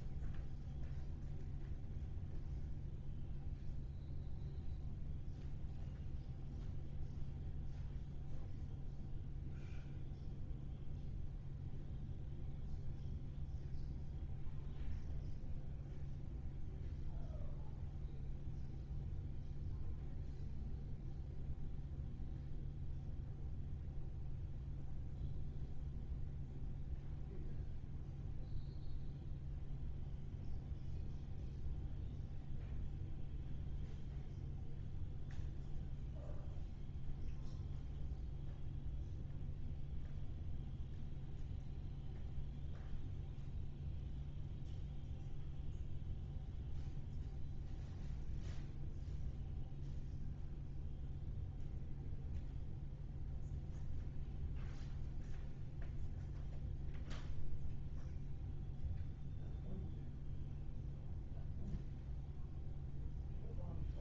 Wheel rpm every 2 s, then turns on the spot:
0, 0, 0, 0, 0, 0, 0, 0, 0, 0, 0, 0, 0, 0, 0, 0, 0, 0, 0, 0, 0, 0, 0, 0, 0, 0, 0, 0, 0, 0, 0, 0.
none